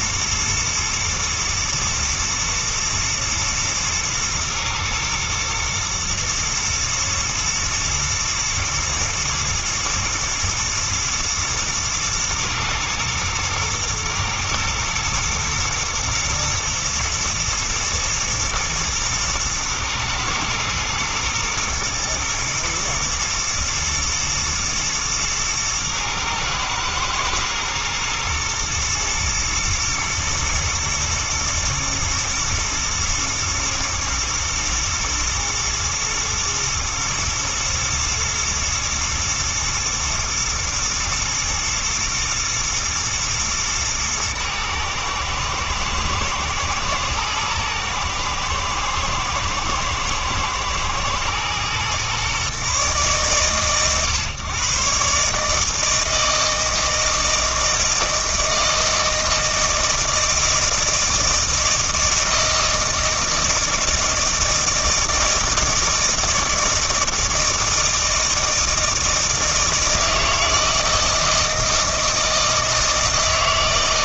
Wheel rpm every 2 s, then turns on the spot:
110, 120, 120, 120, 120, 110, 110, 110, 110, 120, 120, 110, 110, 110, 110, 110, 110, 120, 110, 110, 120, 110, 110, 120, 110, 110, 140, 130, 160, 160, 160, 160, 160, 160, 160, 160, 160.
none